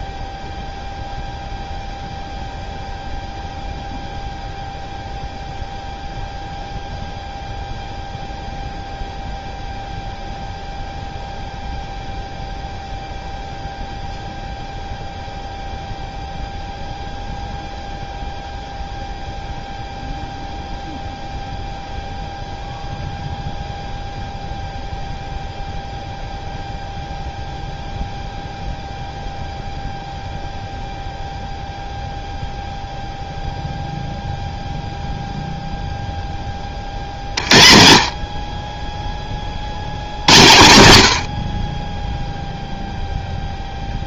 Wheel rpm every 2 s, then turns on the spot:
0, 0, 0, 0, 0, 0, 0, 0, 0, 0, 0, 0, 0, 0, 0, 0, 0, 0, 30, 30, 100, 0.
none